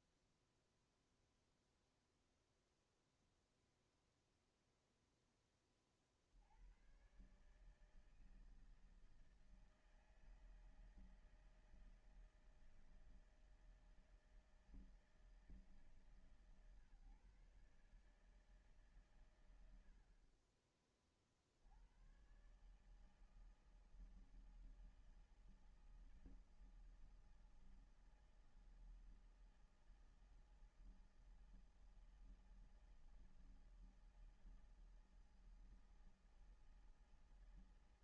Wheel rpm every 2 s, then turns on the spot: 0, 0, 0, 70, 160, 160, 160, 160, 150, 150, 50, 120, 160, 160, 160, 160, 160, 160, 160.
none